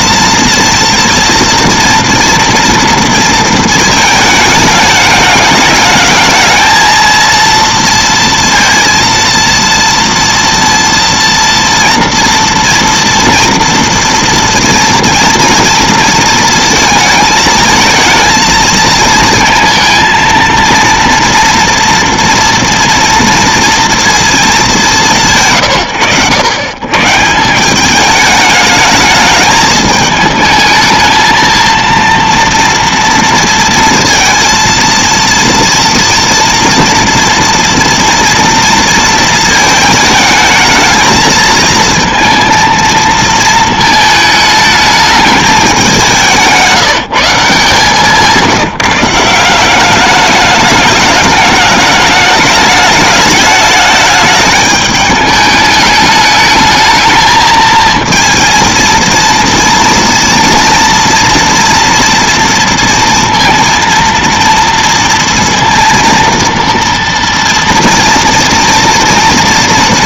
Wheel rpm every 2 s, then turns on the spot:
230, 230, 210, 220, 230, 230, 230, 230, 230, 220, 230, 230, 220, 110, 210, 220, 230, 230, 230, 230, 220, 230, 210, 170, 170, 210, 210, 210, 220, 230, 230, 230, 230, 230, 230.
none